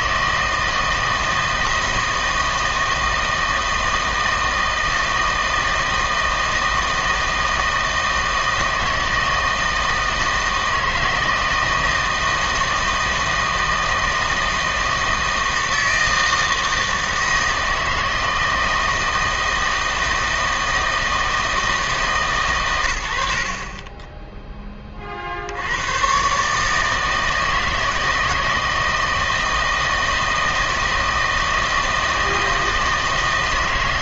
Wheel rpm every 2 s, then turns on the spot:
160, 160, 160, 160, 160, 160, 160, 160, 160, 160, 160, 110, 20, 160, 160, 160, 160.
none